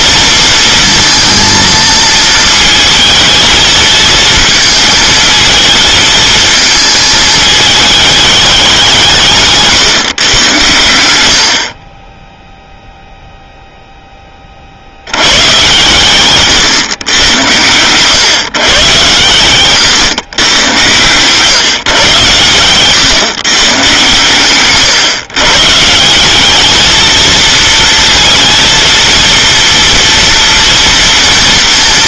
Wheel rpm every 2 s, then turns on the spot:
230, 220, 220, 220, 200, 110, 0, 50, 130, 130, 120, 120, 130, 210, 230, 230.
none